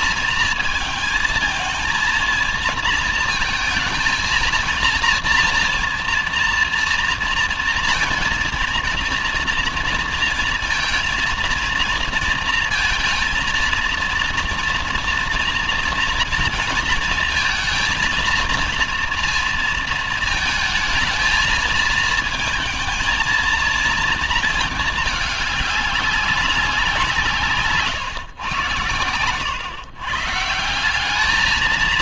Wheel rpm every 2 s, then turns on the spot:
220, 220, 230, 230, 230, 230, 230, 230, 230, 230, 220, 220, 220, 180, 110, 180.
none